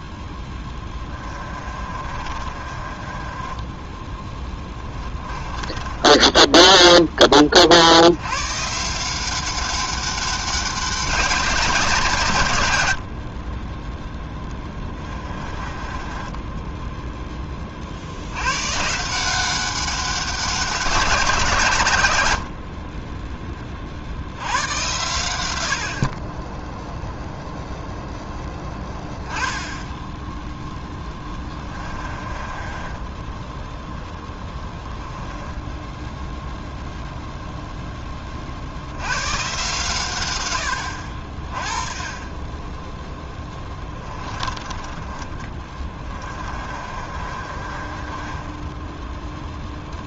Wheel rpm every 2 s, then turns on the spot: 20, 30, 20, 10, 150, 190, 100, 20, 10, 120, 180, 40, 100, 10, 10, 10, 20, 10, 0, 60, 80, 10, 30, 30, 10.
0-8 14-18 32-36 46-50